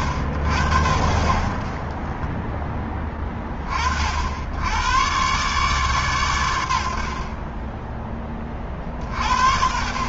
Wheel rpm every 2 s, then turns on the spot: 70, 20, 70, 130, 30.
none